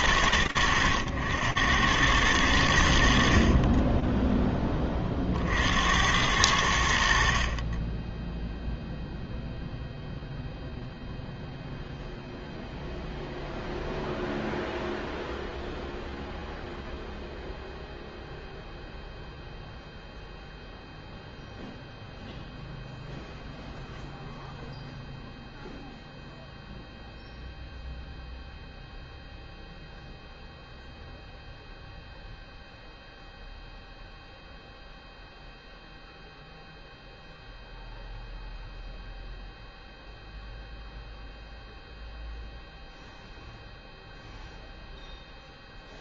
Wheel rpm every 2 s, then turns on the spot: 90, 90, 10, 80, 0, 0, 0, 0, 0, 0, 0, 0, 0, 0, 0, 0, 0, 0, 0, 0, 0, 0, 0.
none